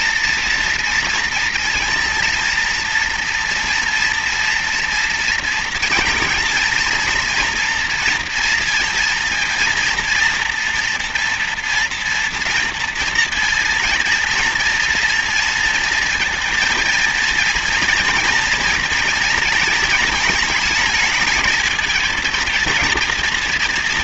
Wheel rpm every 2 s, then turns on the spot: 230, 230, 230, 230, 230, 230, 230, 230, 230, 230, 220, 230.
none